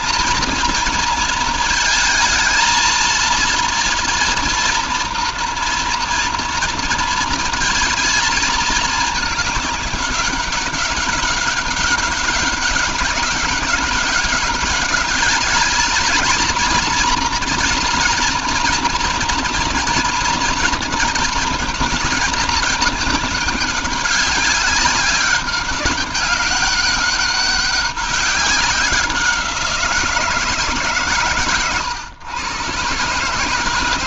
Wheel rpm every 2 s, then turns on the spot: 230, 230, 240, 230, 220, 190, 200, 210, 230, 230, 220, 220, 200, 200, 190, 150, 120.
none